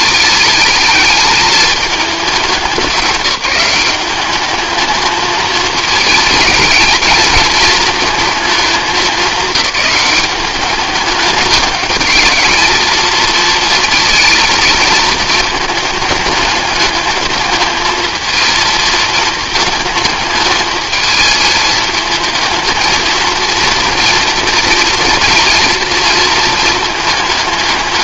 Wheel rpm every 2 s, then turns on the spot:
210, 200, 220, 220, 220, 200, 220, 220, 210, 220, 220, 230, 230, 230.
none